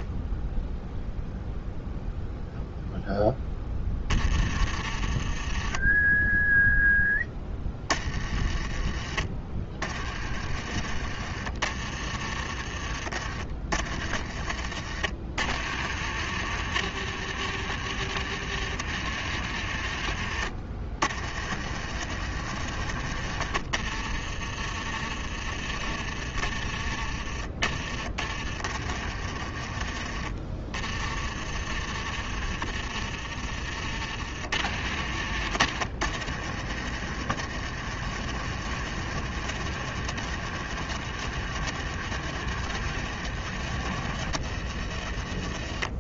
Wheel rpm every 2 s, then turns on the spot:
0, 0, 30, 0, 30, 40, 40, 40, 70, 70, 40, 60, 30, 30, 30, 30, 40, 50, 60, 70, 70, 70, 40.
4-6 10-12 28-34